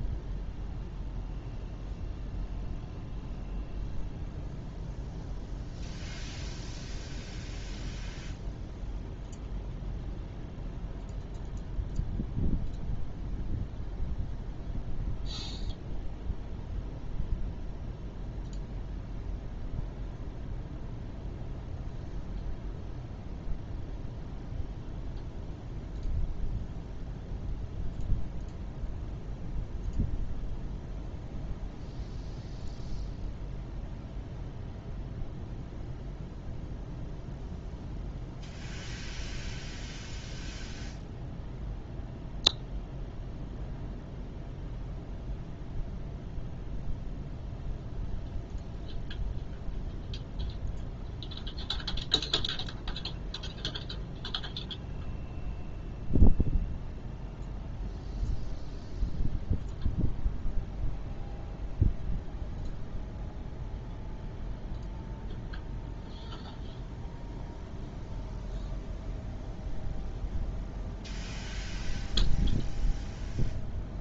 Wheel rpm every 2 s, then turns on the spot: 0, 0, 0, 0, 0, 0, 0, 0, 0, 0, 0, 0, 0, 0, 0, 0, 0, 0, 0, 0, 0, 0, 0, 0, 0, 0, 0, 0, 0, 0, 0, 0, 0, 0, 0, 0, 0.
none